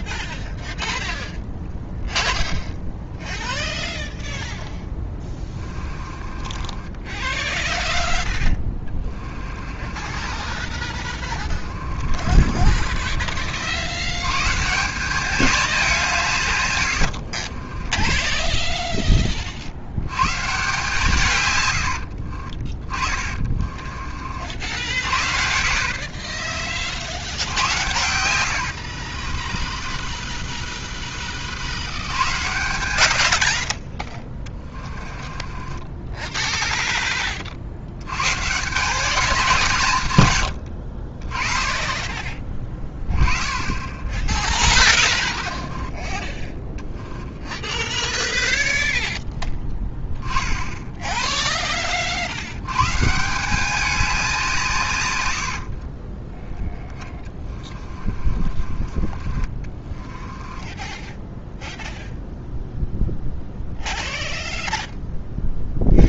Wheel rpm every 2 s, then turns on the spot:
0, 0, 10, 20, 20, 30, 40, 150, 130, 20, 150, 30, 60, 50, 80, 20, 90, 20, 0, 160, 80, 20, 30, 10, 0, 10, 100, 170, 10, 30, 10, 0, 0.
4-14 16-20 22-24 28-30 34-36 44-46 56-62